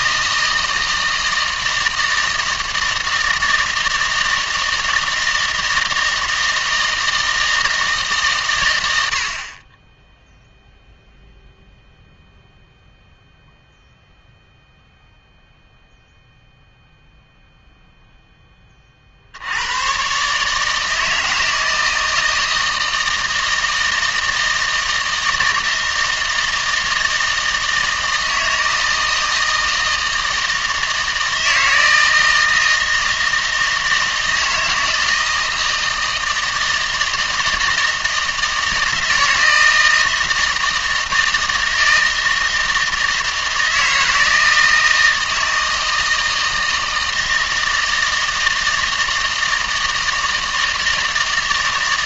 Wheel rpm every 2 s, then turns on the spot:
160, 160, 160, 160, 110, 0, 0, 0, 0, 20, 150, 160, 160, 160, 160, 160, 160, 160, 160, 160, 160, 160, 160, 160, 160, 160.
none